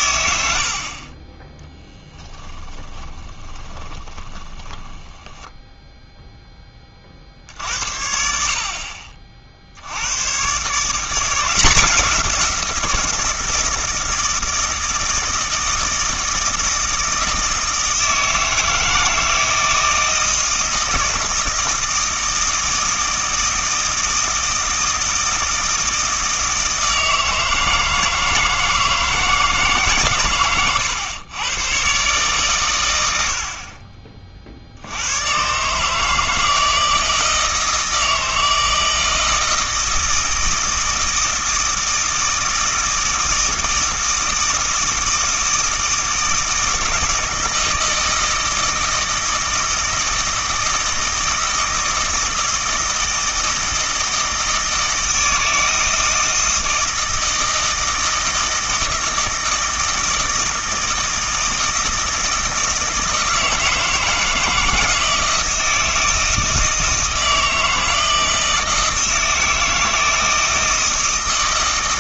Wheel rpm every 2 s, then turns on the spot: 70, 10, 10, 10, 60, 130, 170, 160, 160, 160, 160, 160, 160, 160, 160, 110, 130, 50, 160, 160, 160, 160, 160, 160, 160, 160, 160, 160, 160, 160, 160, 160, 160, 160, 160, 160.
2-6